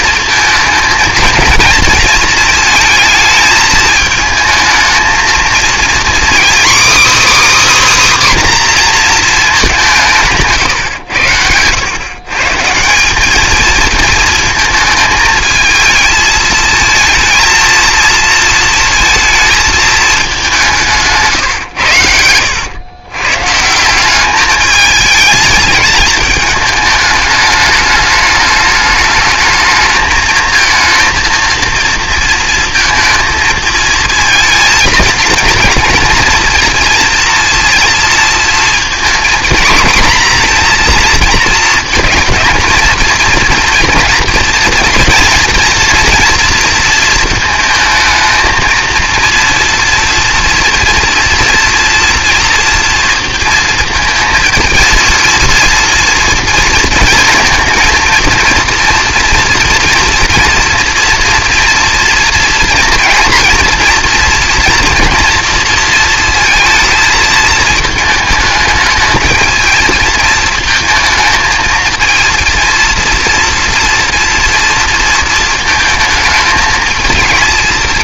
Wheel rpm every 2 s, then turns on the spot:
230, 230, 220, 290, 240, 110, 180, 220, 220, 230, 160, 110, 210, 210, 210, 230, 230, 230, 230, 230, 230, 230, 230, 230, 230, 230, 230, 220, 230, 230, 230, 230, 230, 220, 220, 220, 230, 230, 220.
none